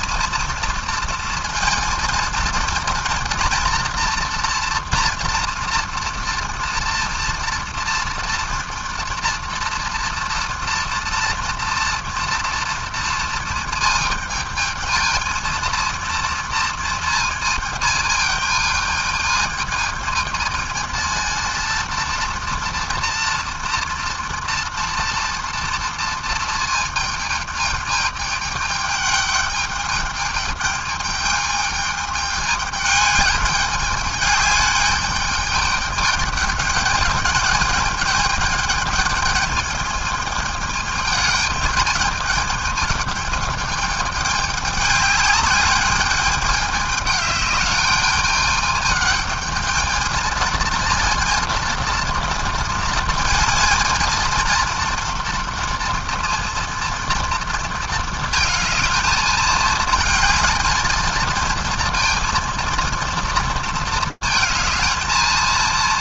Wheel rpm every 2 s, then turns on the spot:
230, 230, 230, 230, 240, 230, 240, 220, 230, 220, 220, 230, 230, 220, 210, 210, 210, 210, 210, 210, 220, 220, 210, 210, 210, 230, 230, 230, 230, 220, 220, 230, 220.
none